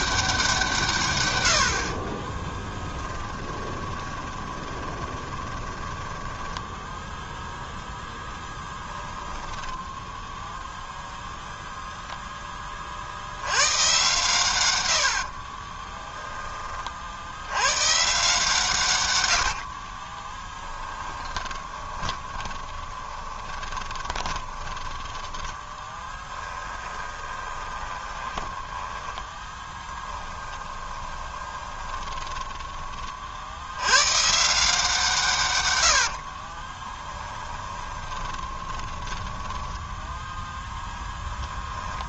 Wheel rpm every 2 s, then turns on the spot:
140, 10, 20, 0, 10, 0, 50, 90, 50, 140, 10, 20, 10, 20, 20, 20, 30, 160, 20, 20, 0.
2-6 8-10 14-16 20-24 26-28 30-32 36-40